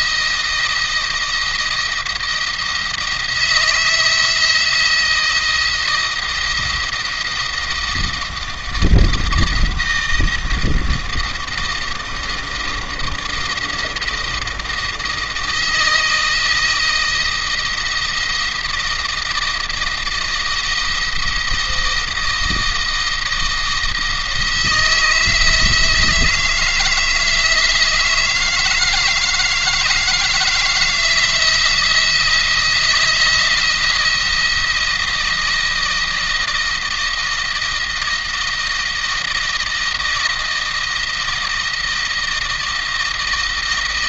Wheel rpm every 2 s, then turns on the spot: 160, 160, 160, 170, 160, 160, 160, 160, 160, 160, 170, 160, 160, 160, 160, 160, 170, 170, 170, 160, 160, 160.
none